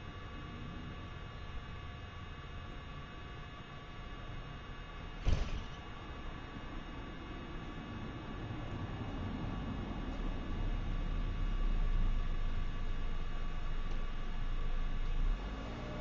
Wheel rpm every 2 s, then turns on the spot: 0, 0, 0, 0, 0, 0, 0, 0.
none